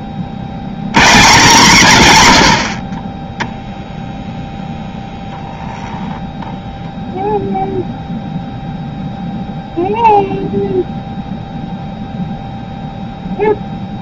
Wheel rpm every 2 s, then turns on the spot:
80, 40, 0, 0, 0, 0, 0.
none